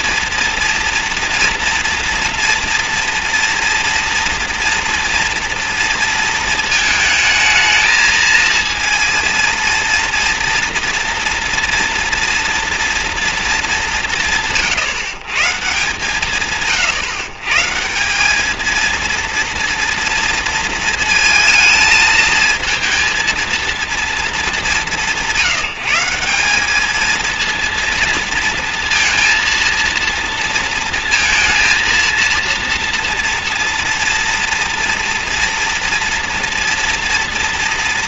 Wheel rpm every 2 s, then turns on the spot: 230, 240, 230, 220, 230, 240, 230, 140, 140, 220, 230, 230, 200, 210, 230, 230, 230, 230, 230.
none